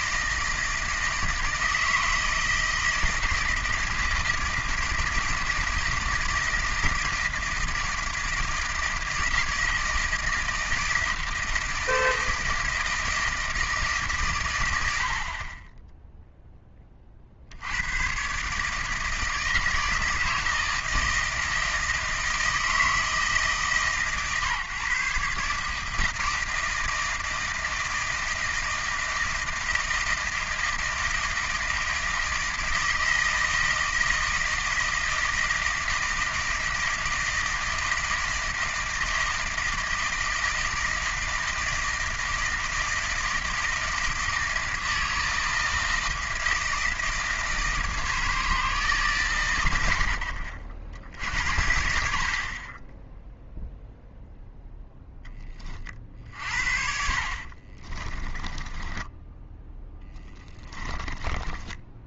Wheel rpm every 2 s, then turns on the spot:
160, 160, 160, 160, 160, 160, 160, 110, 20, 150, 160, 160, 150, 160, 160, 160, 160, 160, 160, 160, 160, 160, 160, 160, 150, 50, 30, 0, 50, 20, 10.
58-62